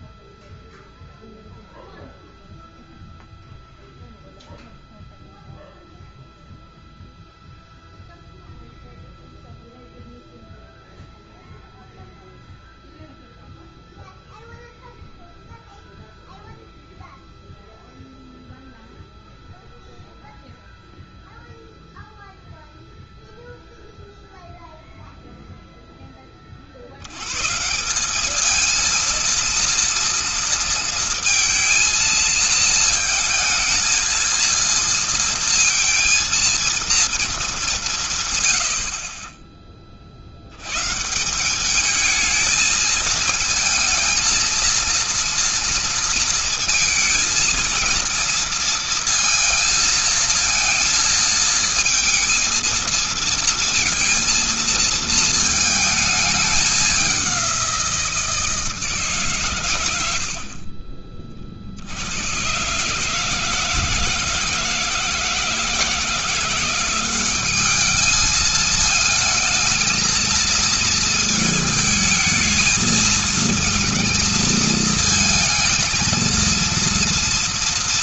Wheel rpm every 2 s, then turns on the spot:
0, 0, 0, 0, 0, 0, 0, 0, 0, 0, 0, 0, 0, 80, 230, 230, 230, 230, 230, 70, 130, 220, 230, 230, 230, 230, 230, 230, 200, 150, 40, 140, 160, 180, 220, 220, 220, 230, 230.
none